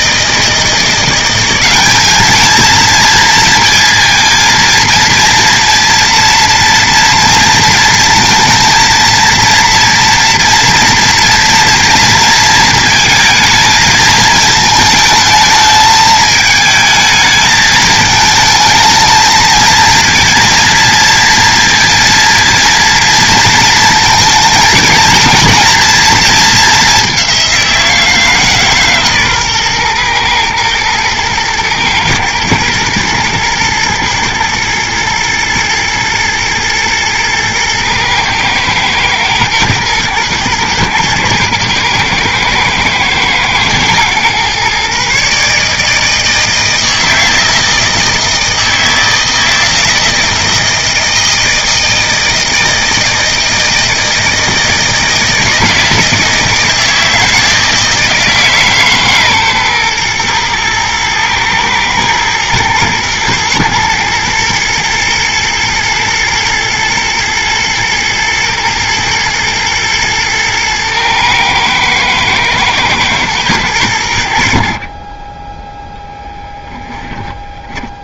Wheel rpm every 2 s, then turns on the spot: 170, 230, 230, 230, 230, 230, 230, 220, 220, 220, 230, 230, 230, 210, 150, 120, 110, 110, 120, 110, 110, 110, 130, 160, 160, 160, 160, 160, 160, 150, 110, 120, 110, 120, 110, 110, 110, 50, 10.
none